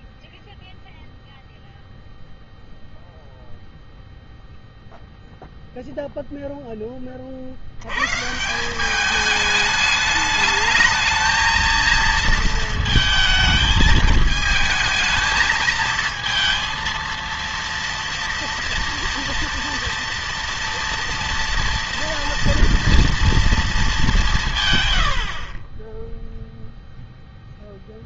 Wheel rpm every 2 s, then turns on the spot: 0, 0, 0, 20, 180, 210, 220, 220, 230, 230, 230, 230, 140, 0.
none